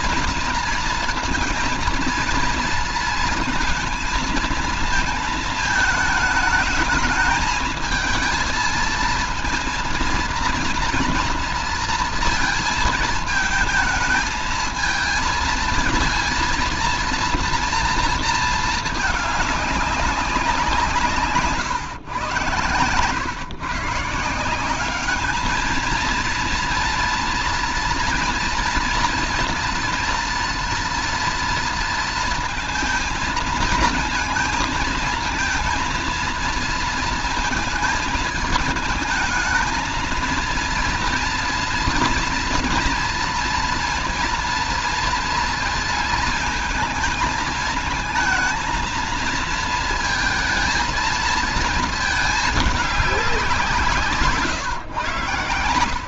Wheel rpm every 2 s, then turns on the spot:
230, 230, 230, 210, 220, 230, 230, 220, 230, 220, 180, 120, 180, 230, 230, 230, 220, 230, 230, 220, 230, 230, 230, 220, 220, 230, 220, 160.
none